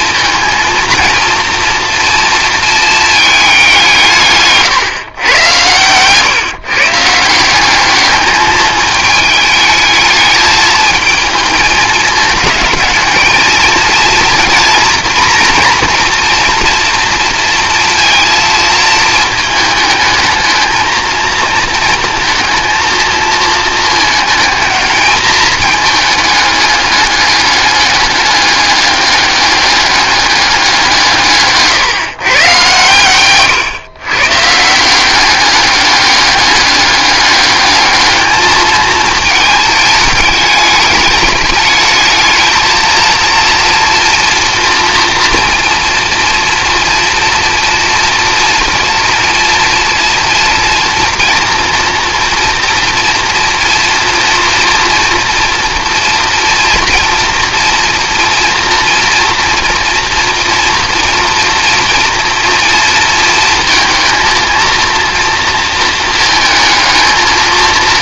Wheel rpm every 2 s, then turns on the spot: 230, 220, 140, 140, 210, 220, 220, 240, 240, 230, 220, 230, 220, 210, 200, 180, 130, 170, 200, 220, 210, 220, 230, 230, 240, 230, 230, 230, 230, 230, 230, 230, 230, 220.
none